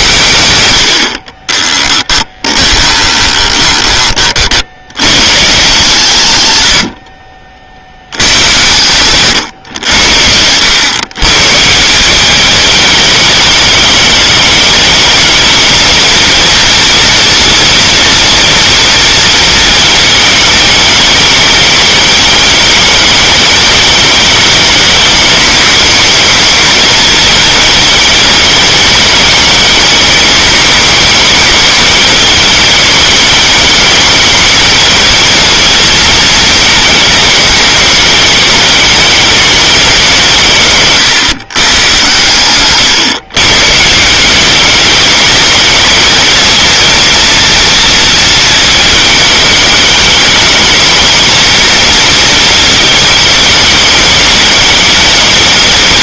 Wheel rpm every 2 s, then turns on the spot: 100, 20, 50, 100, 120, 100, 210, 220, 230, 230, 210, 210, 210, 220, 210, 210, 220, 220, 220, 210, 160, 120, 200, 230, 220, 210, 230, 210.
2-4